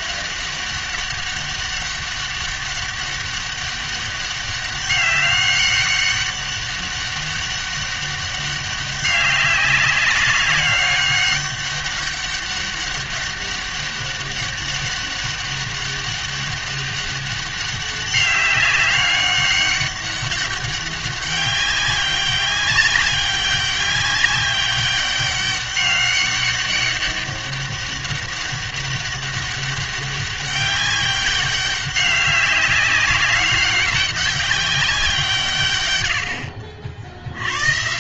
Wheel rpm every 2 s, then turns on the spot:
200, 200, 200, 200, 200, 200, 200, 200, 200, 200, 200, 200, 200, 200, 200, 200, 200, 200, 60.
none